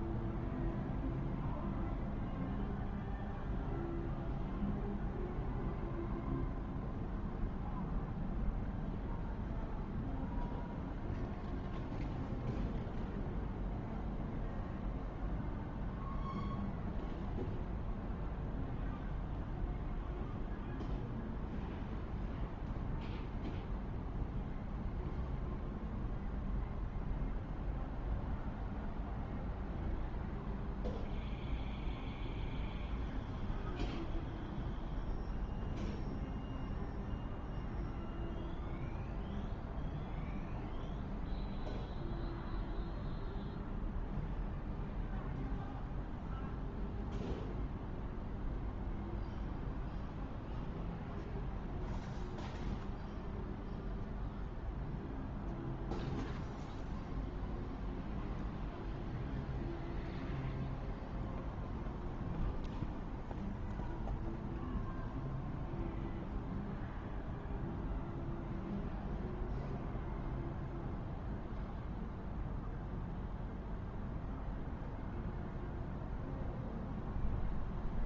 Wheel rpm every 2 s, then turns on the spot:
0, 0, 0, 0, 0, 0, 0, 0, 0, 0, 0, 0, 0, 0, 0, 0, 0, 0, 0, 0, 0, 0, 0, 0, 0, 0, 0, 0, 0, 0, 0, 0, 0, 0, 0, 0, 0, 0, 0.
none